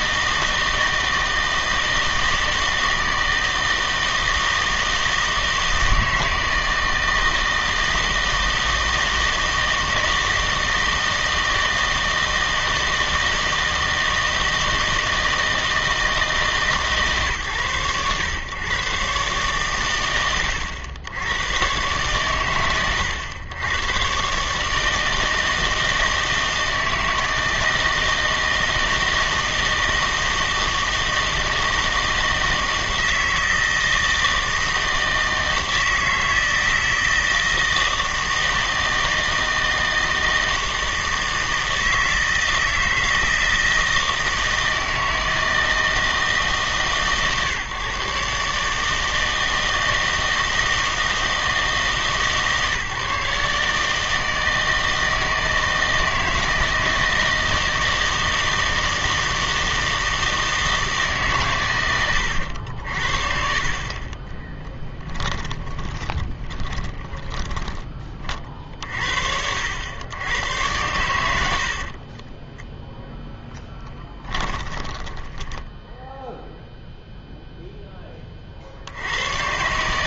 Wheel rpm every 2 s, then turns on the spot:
160, 160, 160, 160, 160, 160, 160, 160, 140, 120, 90, 100, 150, 160, 160, 160, 160, 160, 160, 160, 160, 160, 160, 150, 150, 160, 140, 160, 160, 160, 160, 70, 10, 20, 60, 100, 10, 20, 0, 70.
64-68 74-76